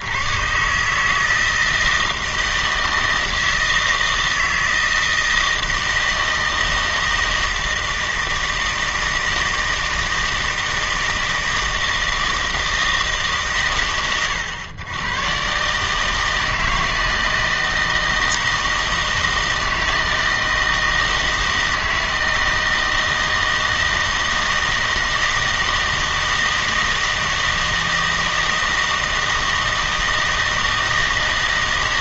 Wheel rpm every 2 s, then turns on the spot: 140, 160, 160, 160, 160, 160, 160, 110, 160, 160, 160, 160, 160, 160, 160, 160.
none